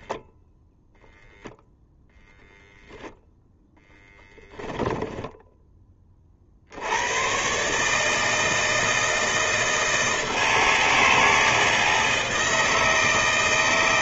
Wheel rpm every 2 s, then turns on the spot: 0, 0, 10, 110, 160, 160, 160.
none